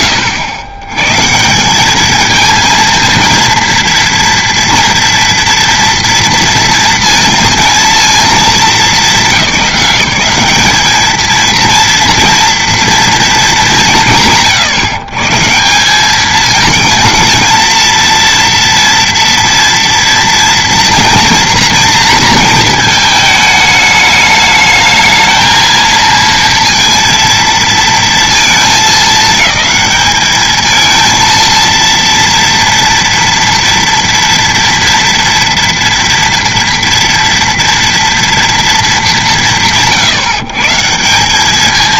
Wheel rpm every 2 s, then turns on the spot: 130, 230, 230, 230, 210, 220, 230, 130, 220, 230, 240, 220, 220, 230, 210, 220, 230, 230, 230, 180, 170.
none